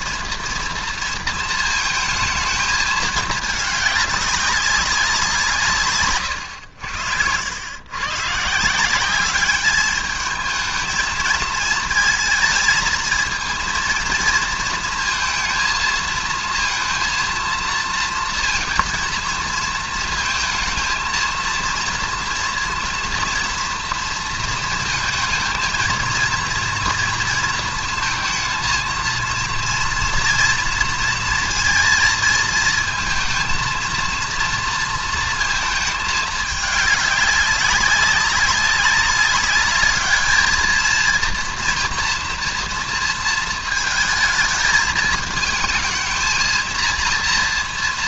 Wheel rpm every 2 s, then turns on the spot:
230, 220, 200, 90, 160, 220, 220, 230, 230, 230, 220, 230, 230, 230, 220, 230, 220, 230, 210, 200, 220, 230, 220, 230.
none